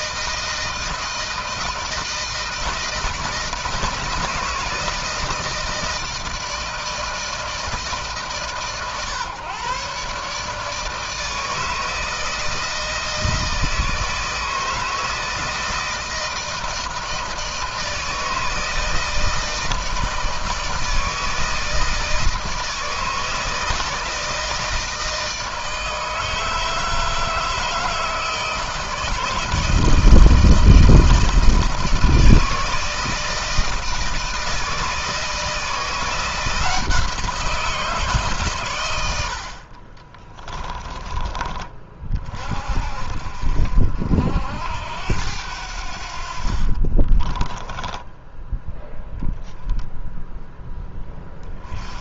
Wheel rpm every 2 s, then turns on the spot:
160, 160, 160, 160, 130, 150, 160, 160, 160, 160, 160, 160, 160, 160, 160, 160, 160, 160, 170, 110, 20, 50, 80, 50, 10, 10.
40-42 46-48